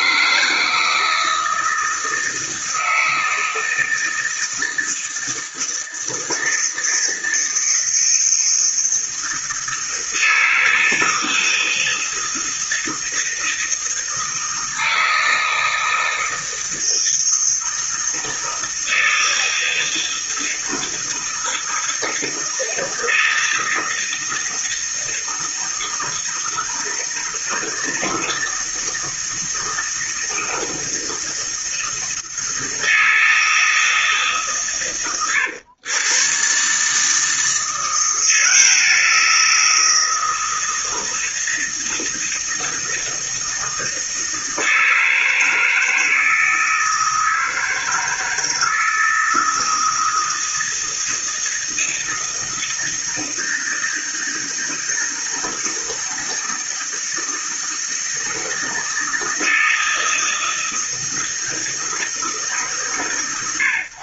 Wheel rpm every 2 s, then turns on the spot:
160, 160, 160, 160, 160, 160, 160, 160, 160, 160, 160, 160, 160, 160, 160, 160, 160, 140, 140, 170, 160, 160, 160, 160, 160, 160, 160, 160, 160, 160, 160, 140.
none